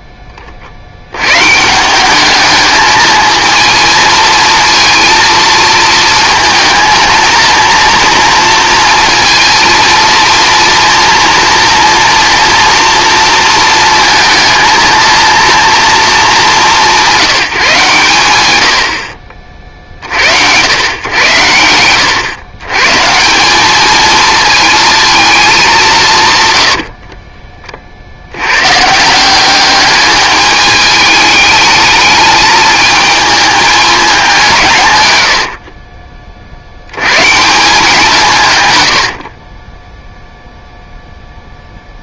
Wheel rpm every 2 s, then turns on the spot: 20, 210, 220, 220, 230, 230, 230, 230, 190, 90, 90, 120, 230, 100, 110, 210, 220, 160, 60, 140, 0.
38-40